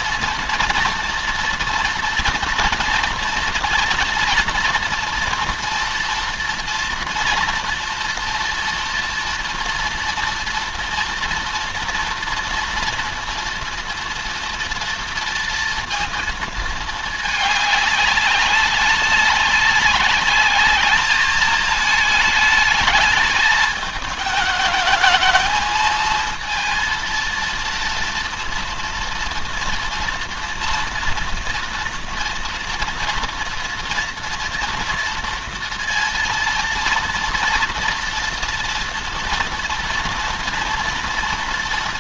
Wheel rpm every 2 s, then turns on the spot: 230, 230, 230, 240, 230, 230, 230, 230, 220, 200, 210, 210, 220, 220, 230, 230, 230, 230, 230, 230, 230.
none